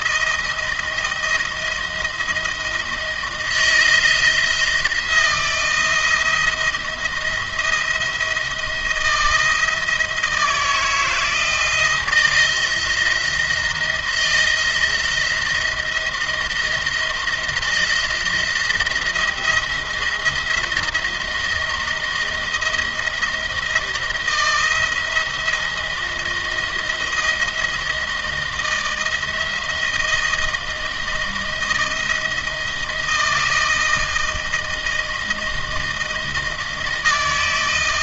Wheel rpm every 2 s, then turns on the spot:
160, 160, 160, 170, 170, 160, 160, 170, 170, 170, 170, 170, 170, 170, 160, 160, 170, 160, 160.
none